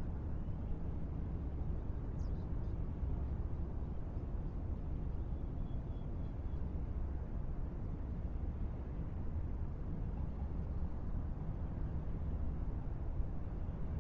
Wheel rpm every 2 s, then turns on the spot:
0, 0, 0, 0, 0, 0, 0.
none